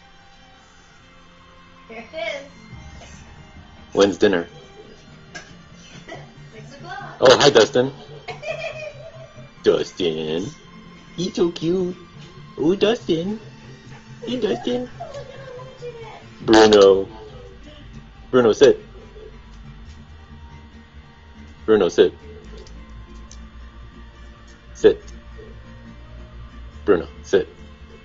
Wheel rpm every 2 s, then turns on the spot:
0, 0, 0, 0, 0, 0, 0, 0, 0, 0, 0, 0, 0, 0.
none